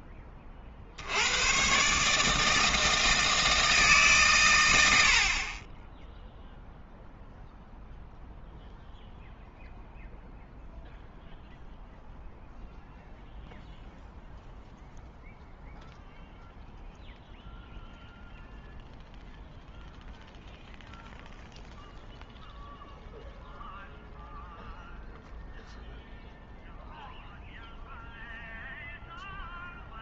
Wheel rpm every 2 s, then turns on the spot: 50, 160, 100, 0, 0, 0, 0, 0, 0, 0, 0, 0, 0, 0, 0.
none